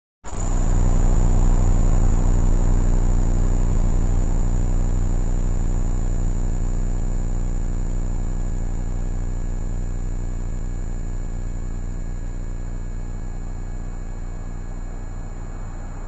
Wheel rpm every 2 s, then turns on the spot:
0, 0, 0, 0, 0, 0, 0, 0.
none